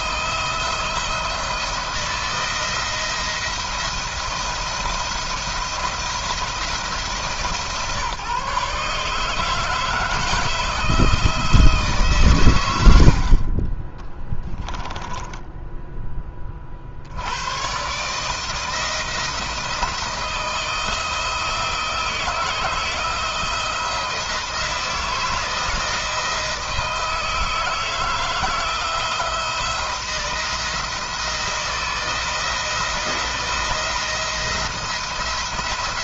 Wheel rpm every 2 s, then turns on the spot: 170, 170, 160, 160, 140, 160, 90, 10, 50, 160, 160, 160, 160, 160, 160, 170, 160, 170.
12-16